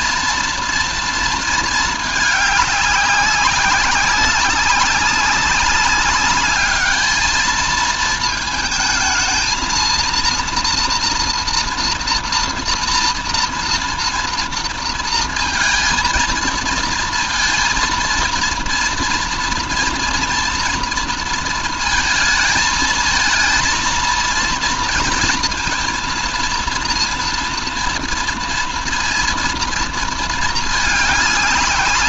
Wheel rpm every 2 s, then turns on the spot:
230, 200, 190, 210, 220, 230, 230, 230, 230, 230, 230, 220, 230, 230, 230, 210.
none